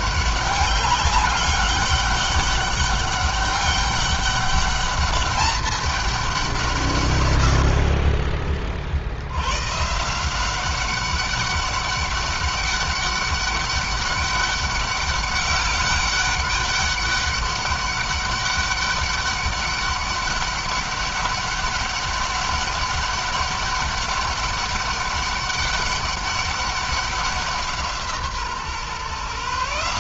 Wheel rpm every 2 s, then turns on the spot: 200, 200, 200, 160, 40, 190, 200, 190, 200, 200, 200, 200, 200, 190, 140.
none